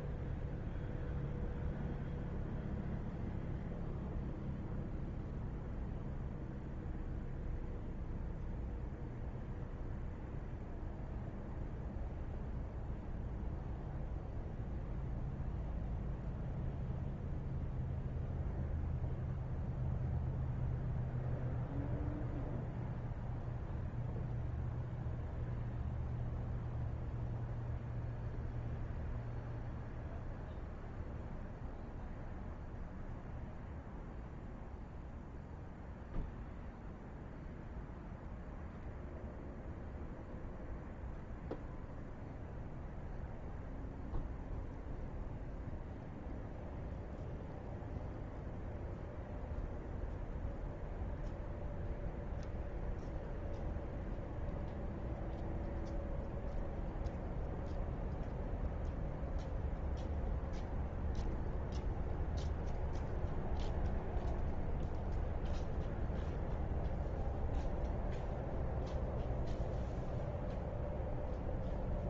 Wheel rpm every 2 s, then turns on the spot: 0, 0, 0, 0, 0, 0, 0, 0, 0, 0, 0, 0, 0, 0, 0, 0, 0, 0, 0, 0, 0, 0, 0, 0, 0, 0, 0, 0, 0, 0, 0, 0, 0, 0, 0, 0.
none